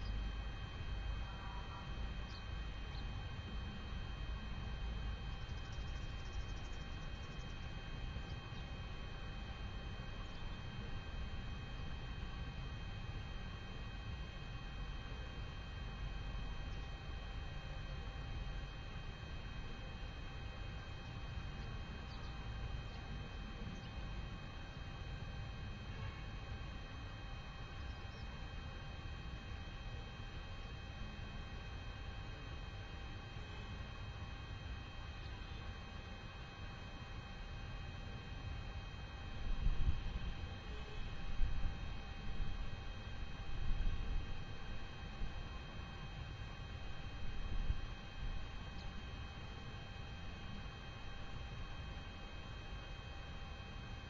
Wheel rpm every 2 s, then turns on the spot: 0, 0, 0, 0, 0, 0, 0, 0, 0, 0, 0, 0, 0, 0, 0, 0, 0, 0, 0, 0, 0, 0, 0, 0, 0, 0, 0.
none